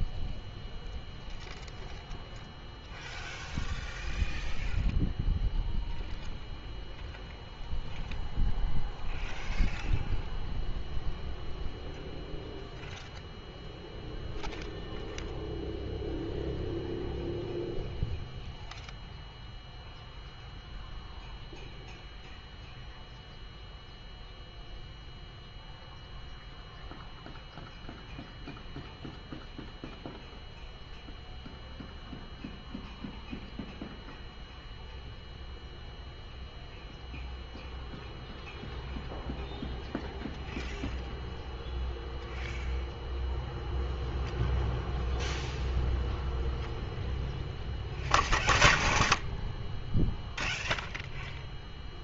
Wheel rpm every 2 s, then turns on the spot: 0, 0, 0, 0, 0, 0, 0, 0, 0, 0, 0, 0, 0, 0, 0, 0, 0, 0, 0, 0, 0, 0, 0, 0, 0, 0.
none